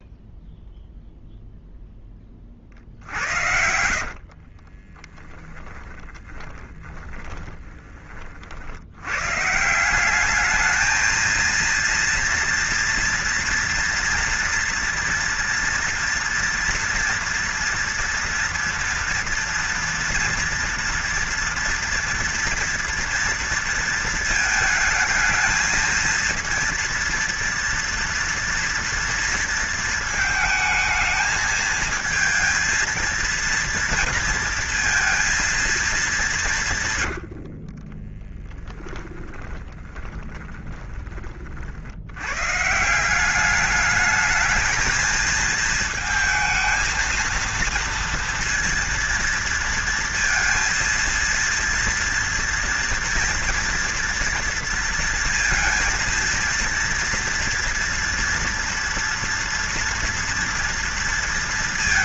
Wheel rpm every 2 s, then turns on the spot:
0, 50, 30, 10, 80, 220, 230, 230, 230, 230, 230, 230, 220, 230, 230, 220, 230, 230, 130, 10, 20, 160, 220, 220, 230, 230, 230, 230, 230, 230, 230.
2-8 36-40